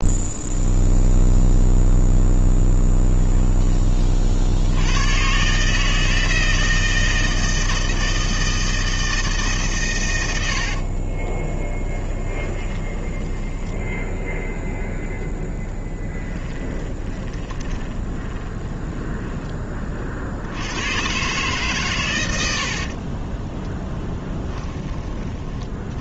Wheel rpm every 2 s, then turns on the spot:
0, 10, 90, 160, 160, 40, 10, 0, 20, 10, 100, 60, 20.
10-14 16-20 22-24